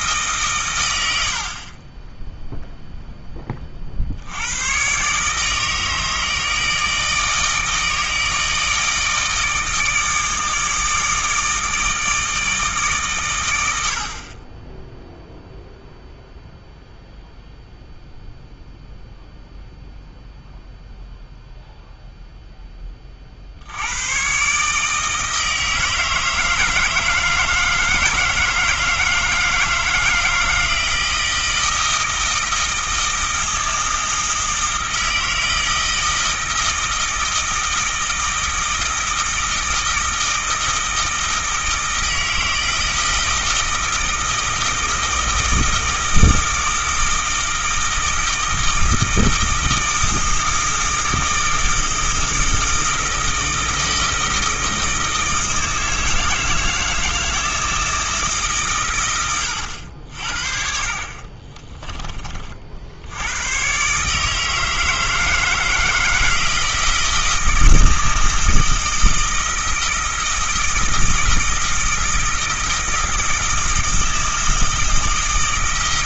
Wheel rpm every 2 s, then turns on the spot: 120, 0, 110, 160, 160, 160, 150, 10, 0, 0, 0, 10, 150, 160, 160, 160, 160, 160, 160, 160, 160, 160, 160, 160, 160, 160, 160, 160, 160, 130, 50, 60, 160, 160, 160, 160, 160, 160.
none